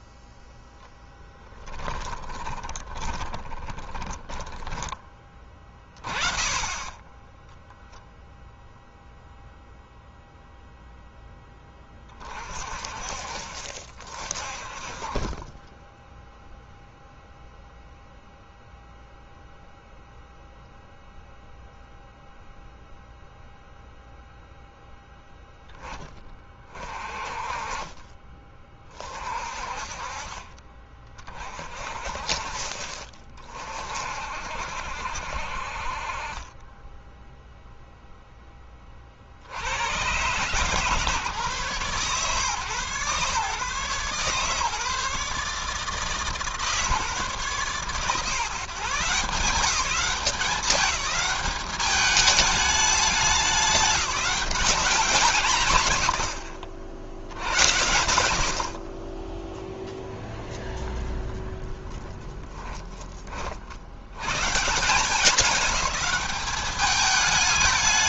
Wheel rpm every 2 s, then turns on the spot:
10, 20, 20, 20, 0, 0, 30, 30, 0, 0, 0, 0, 0, 20, 30, 40, 40, 50, 20, 10, 130, 140, 140, 150, 140, 200, 210, 190, 100, 60, 0, 20, 140, 210.
2-6 62-64